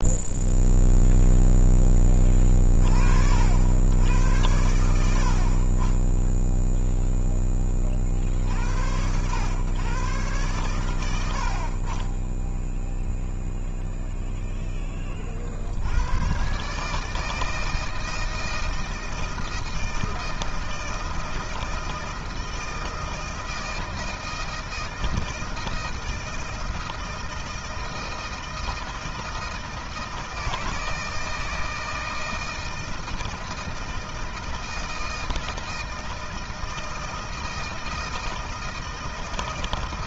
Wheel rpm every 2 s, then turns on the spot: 0, 20, 90, 10, 60, 130, 20, 0, 110, 160, 160, 160, 160, 160, 160, 160, 160, 160, 160, 160.
none